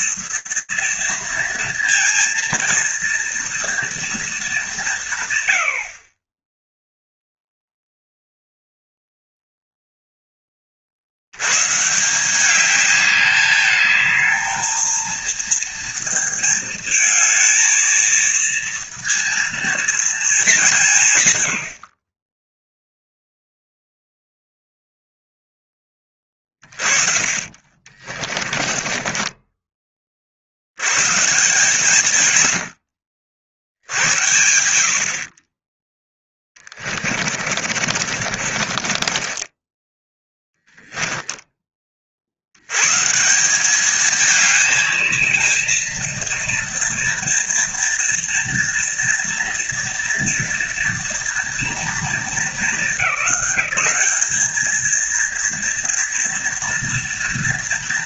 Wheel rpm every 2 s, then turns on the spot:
230, 230, 230, 40, 0, 10, 190, 220, 230, 230, 210, 10, 0, 30, 20, 80, 90, 70, 30, 40, 10, 120, 220, 230, 230, 230, 210, 220, 240.
28-30 36-40